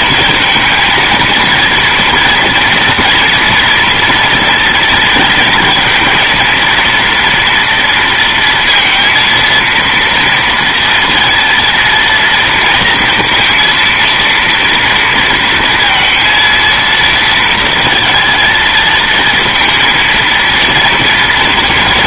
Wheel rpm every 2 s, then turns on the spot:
230, 240, 230, 230, 230, 230, 230, 230, 230, 230, 230.
none